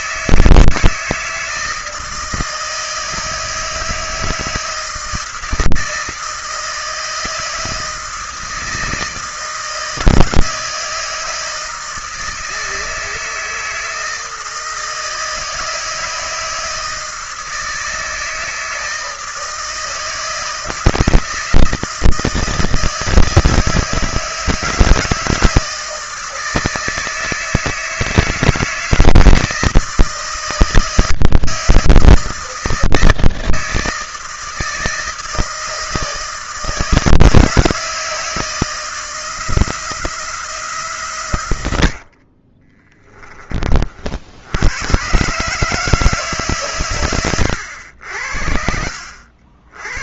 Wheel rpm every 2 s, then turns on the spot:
160, 160, 160, 160, 160, 160, 160, 160, 160, 160, 160, 160, 160, 160, 160, 160, 160, 160, 160, 160, 140, 20, 110, 130, 60.
42-44